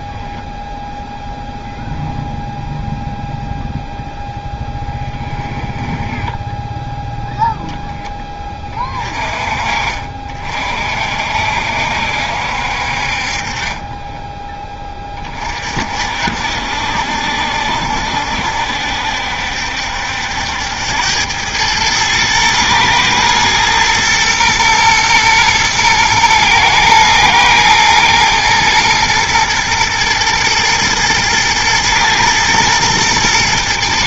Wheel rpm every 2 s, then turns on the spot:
0, 0, 10, 0, 20, 50, 60, 20, 60, 70, 90, 120, 120, 110, 110, 110, 110.
4-6